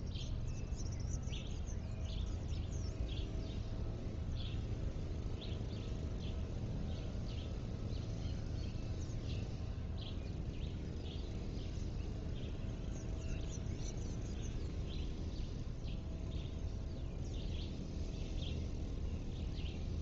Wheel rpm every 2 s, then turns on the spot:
0, 0, 0, 0, 0, 0, 0, 0, 0, 0.
none